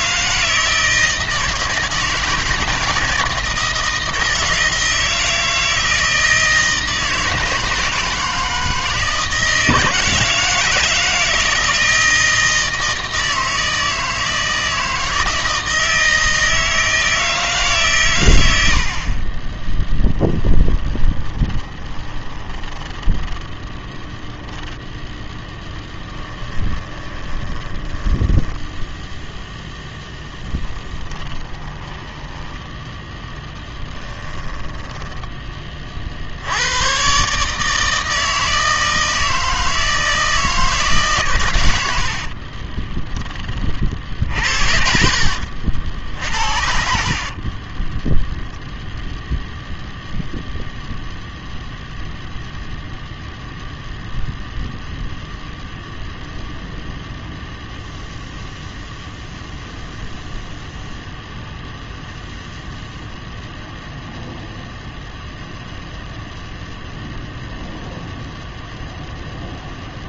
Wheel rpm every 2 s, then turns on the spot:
160, 160, 160, 160, 160, 160, 160, 160, 160, 70, 10, 20, 10, 20, 0, 10, 10, 10, 110, 160, 160, 30, 70, 60, 0, 0, 0, 0, 0, 0, 0, 0, 0, 0, 0.
20-24 26-28 30-32 34-36 42-48